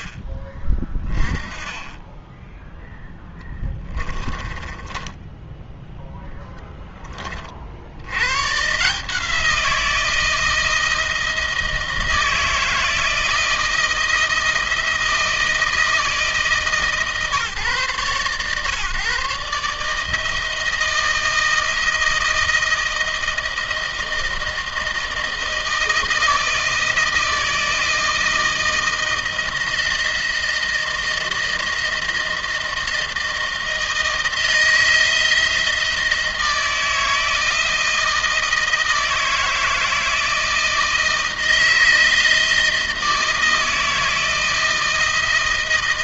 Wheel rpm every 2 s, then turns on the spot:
20, 10, 10, 20, 150, 160, 160, 160, 150, 130, 160, 160, 160, 160, 160, 160, 160, 160, 160, 160, 160, 160, 160.
4-6